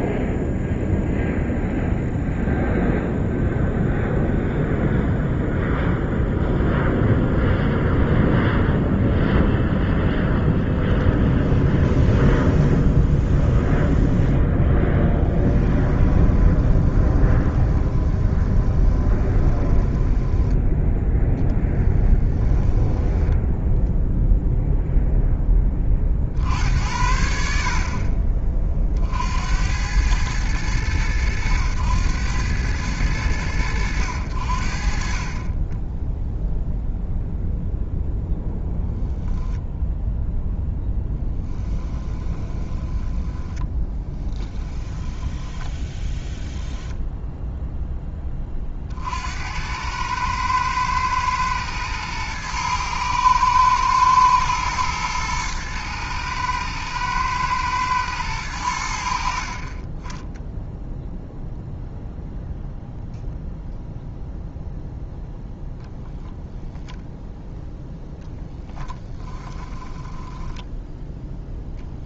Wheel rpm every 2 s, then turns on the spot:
0, 0, 0, 0, 0, 10, 10, 0, 20, 20, 20, 10, 0, 60, 50, 100, 90, 50, 0, 0, 10, 10, 10, 0, 50, 110, 110, 110, 110, 80, 0, 0, 0, 0, 10, 10.
10-14 16-20 22-24 40-46 68-70